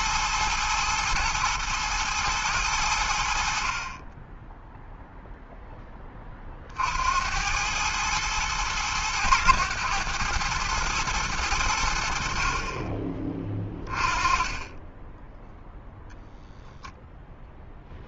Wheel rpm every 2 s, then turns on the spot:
110, 80, 0, 60, 110, 110, 30, 20, 0.
none